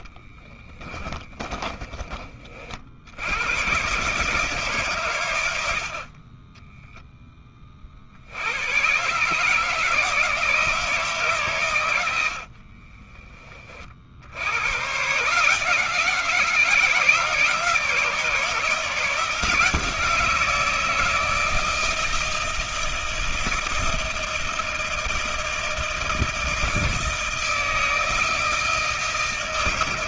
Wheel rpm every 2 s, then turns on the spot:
30, 40, 140, 10, 100, 160, 50, 110, 160, 160, 160, 160, 170, 160, 160.
0-2 6-8 12-14